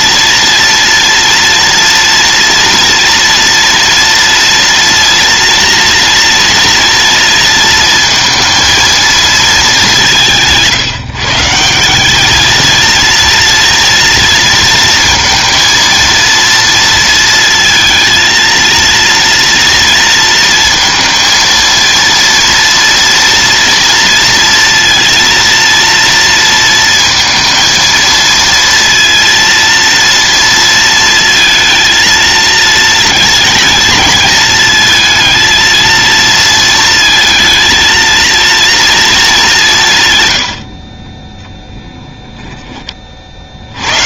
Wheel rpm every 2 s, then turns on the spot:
230, 230, 230, 230, 230, 160, 230, 230, 230, 230, 230, 230, 230, 230, 230, 230, 220, 220, 230, 230, 60, 20.
none